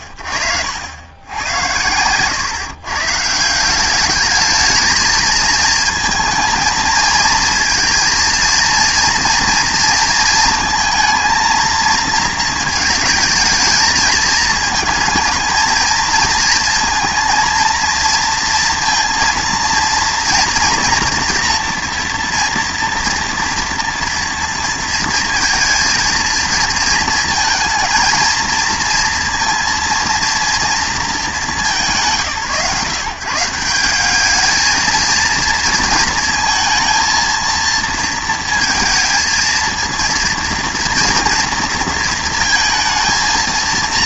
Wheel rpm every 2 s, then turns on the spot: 80, 120, 210, 220, 230, 220, 220, 220, 230, 230, 230, 230, 230, 220, 230, 230, 140, 210, 230, 230, 230, 230.
none